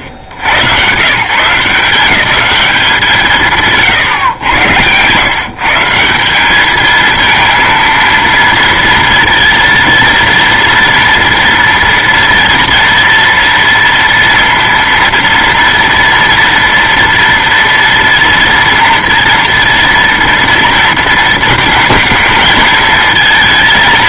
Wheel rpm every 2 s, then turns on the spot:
90, 200, 120, 210, 230, 230, 230, 230, 240, 230, 230, 220.
none